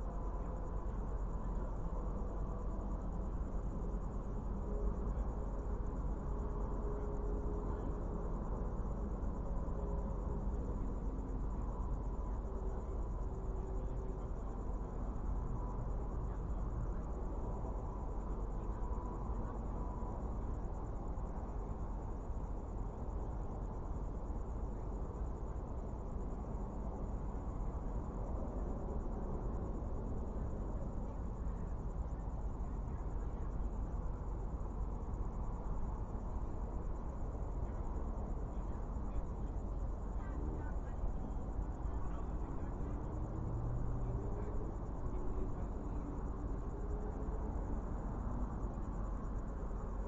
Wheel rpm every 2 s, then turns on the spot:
0, 0, 0, 0, 0, 0, 0, 0, 0, 0, 0, 0, 0, 0, 0, 0, 0, 0, 0, 0, 0, 0, 0, 0, 0.
none